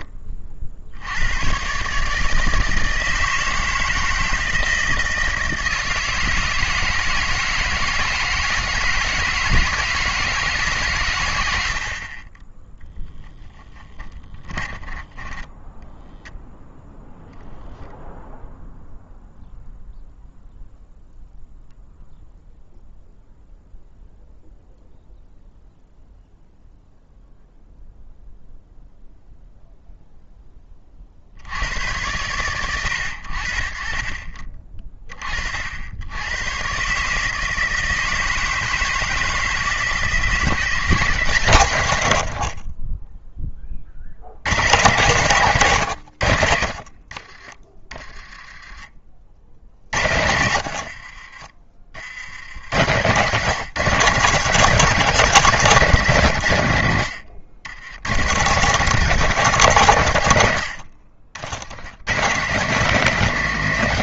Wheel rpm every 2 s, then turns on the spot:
60, 160, 160, 160, 160, 140, 10, 10, 0, 0, 0, 0, 0, 0, 0, 30, 100, 30, 130, 160, 180, 40, 130, 50, 20, 80, 100, 200, 110, 190, 90, 180.
14-16 42-44 48-52